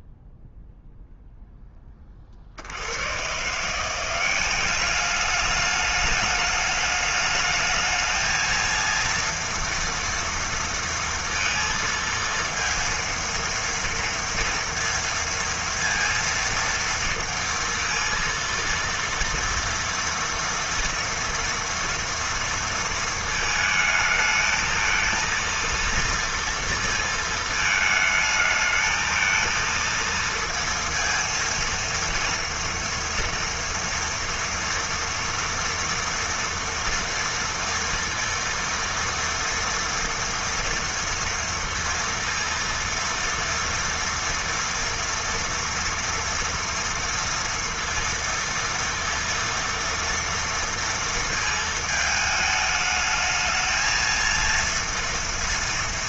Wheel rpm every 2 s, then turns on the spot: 0, 60, 200, 210, 230, 230, 230, 230, 230, 230, 230, 230, 220, 230, 220, 230, 230, 230, 230, 230, 230, 230, 230, 230, 230, 230, 220, 230.
none